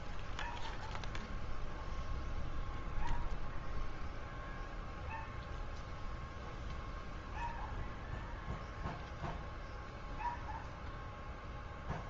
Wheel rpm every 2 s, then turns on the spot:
0, 0, 0, 0, 0, 0.
none